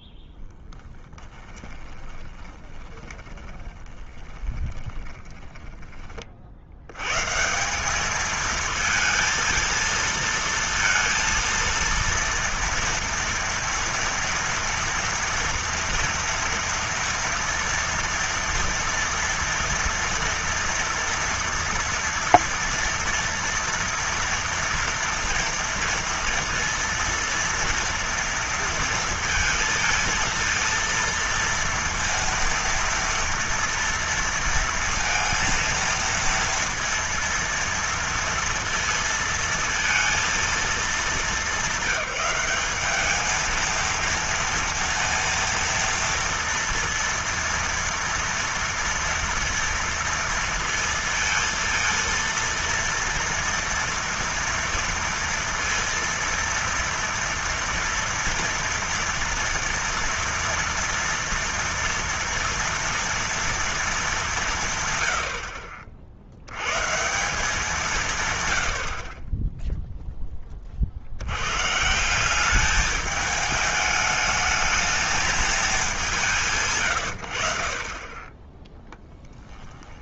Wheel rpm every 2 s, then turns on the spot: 20, 20, 20, 70, 220, 230, 230, 230, 230, 230, 230, 230, 230, 230, 230, 230, 230, 230, 230, 230, 230, 200, 230, 230, 230, 230, 230, 230, 230, 230, 230, 230, 180, 90, 130, 20, 190, 220, 170, 20.
0-6